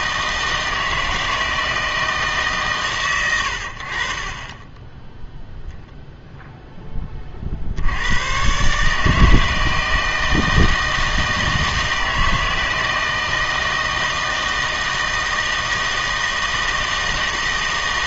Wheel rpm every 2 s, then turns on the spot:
160, 140, 20, 0, 130, 160, 160, 160, 160.
none